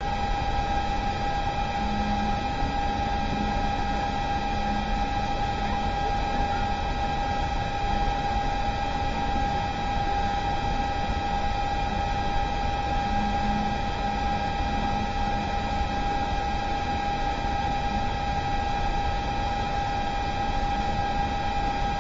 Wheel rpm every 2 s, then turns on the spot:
0, 0, 0, 0, 0, 0, 0, 0, 0, 0, 0.
none